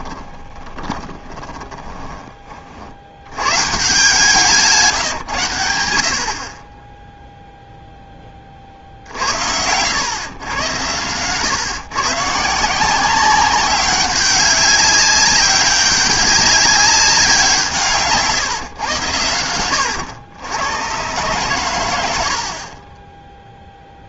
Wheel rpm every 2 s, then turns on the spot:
20, 70, 160, 20, 50, 110, 180, 200, 200, 120, 110, 40.
0-2